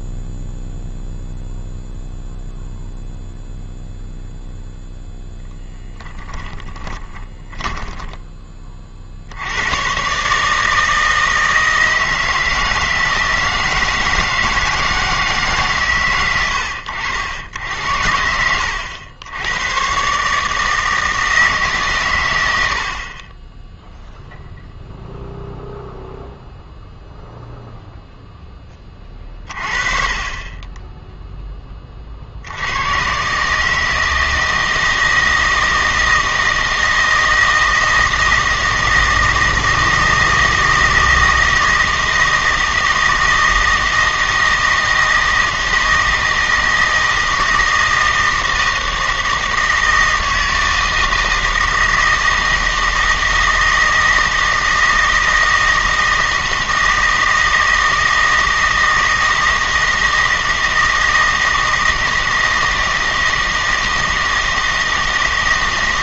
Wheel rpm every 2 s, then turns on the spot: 0, 0, 0, 10, 30, 160, 160, 160, 90, 90, 160, 80, 0, 0, 20, 10, 80, 160, 160, 160, 160, 160, 160, 160, 160, 160, 160, 160, 160, 160, 160, 160, 160.
6-8